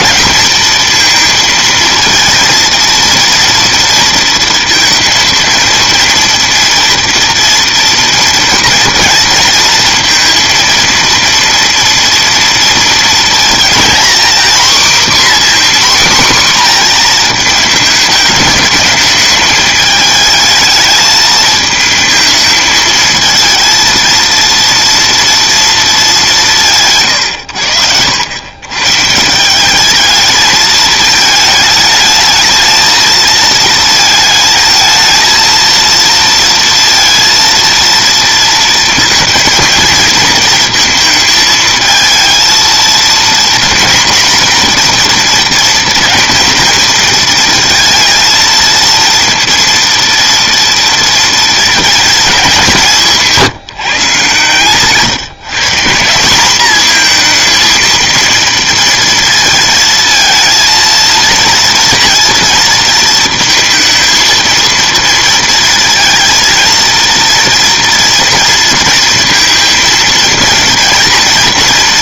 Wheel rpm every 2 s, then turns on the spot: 220, 230, 220, 230, 230, 230, 230, 260, 250, 210, 220, 220, 230, 160, 140, 220, 220, 220, 230, 230, 230, 230, 240, 230, 230, 230, 170, 130, 220, 230, 230, 230, 230, 230, 230, 230.
none